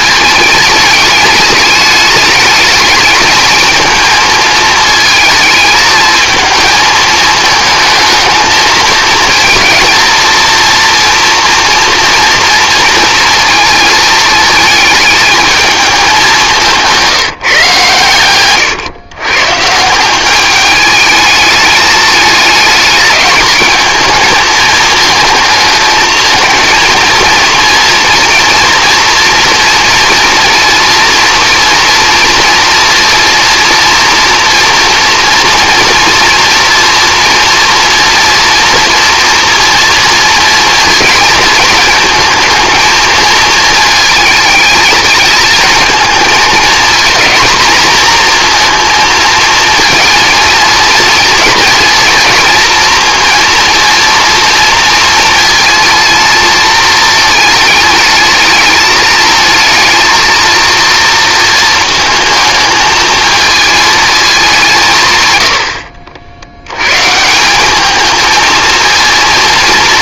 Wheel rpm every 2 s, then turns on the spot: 210, 210, 220, 220, 220, 230, 230, 220, 180, 120, 210, 210, 220, 230, 230, 230, 230, 230, 230, 230, 230, 220, 220, 220, 230, 230, 230, 230, 220, 220, 230, 220, 160, 110, 230.
none